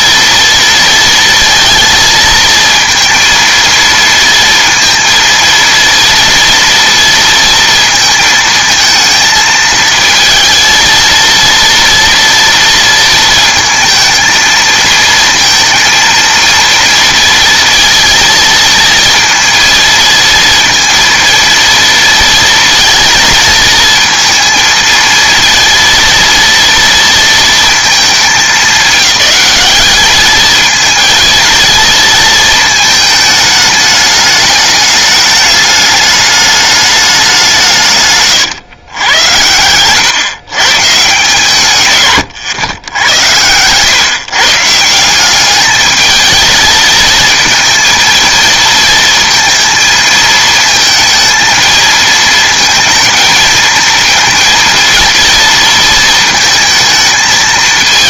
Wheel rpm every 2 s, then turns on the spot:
230, 230, 230, 230, 220, 230, 230, 220, 230, 220, 230, 230, 230, 230, 200, 230, 220, 210, 210, 130, 150, 110, 160, 220, 230, 230, 220, 230, 230.
none